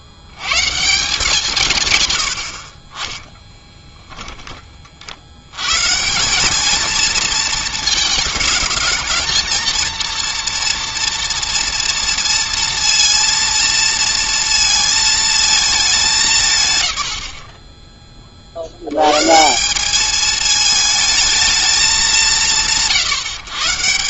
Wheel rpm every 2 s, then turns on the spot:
130, 50, 20, 210, 220, 240, 230, 230, 150, 70, 220, 160.
none